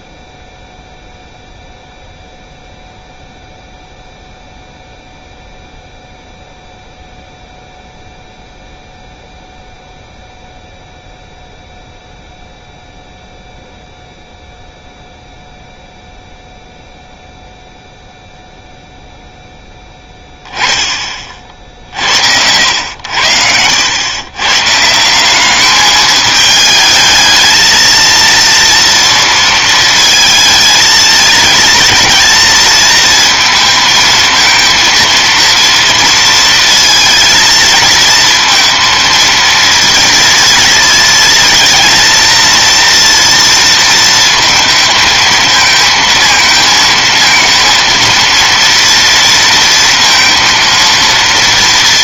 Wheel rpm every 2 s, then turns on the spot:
0, 0, 0, 0, 0, 0, 0, 0, 0, 0, 10, 80, 140, 220, 230, 220, 230, 230, 230, 230, 230, 230, 220, 230, 230, 230.
none